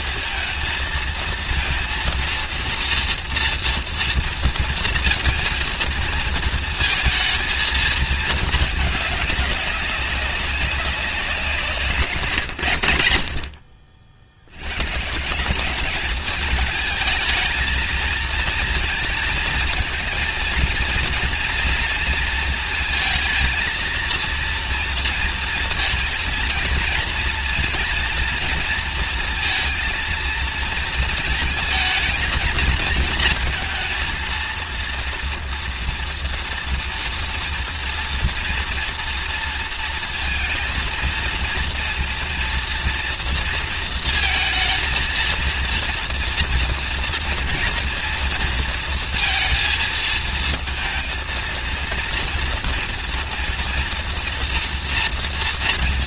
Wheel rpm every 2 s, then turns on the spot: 230, 230, 230, 230, 210, 190, 110, 100, 220, 230, 230, 230, 230, 230, 230, 220, 220, 230, 230, 230, 230, 230, 230, 240, 230, 230, 230, 240.
none